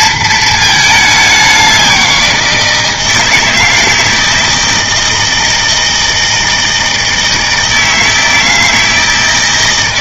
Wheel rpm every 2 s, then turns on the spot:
220, 170, 160, 160, 160.
none